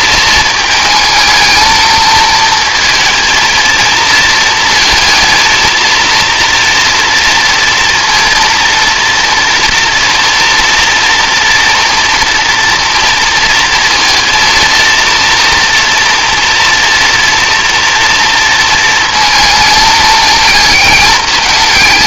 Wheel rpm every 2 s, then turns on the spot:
220, 230, 230, 230, 230, 240, 230, 230, 230, 230, 220.
none